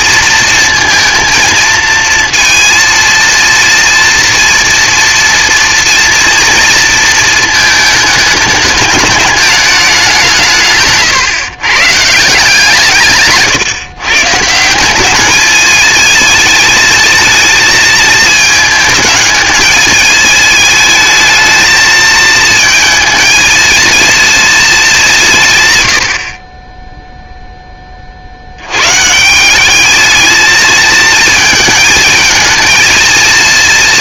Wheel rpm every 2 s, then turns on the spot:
230, 230, 230, 230, 210, 150, 160, 170, 220, 220, 220, 220, 220, 30, 90, 220, 220.
none